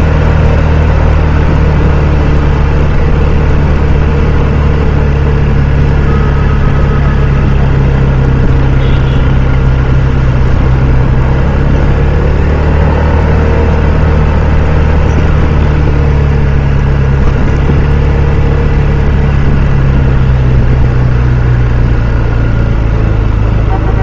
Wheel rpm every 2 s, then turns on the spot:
0, 0, 0, 0, 0, 0, 0, 0, 0, 0, 0, 0.
none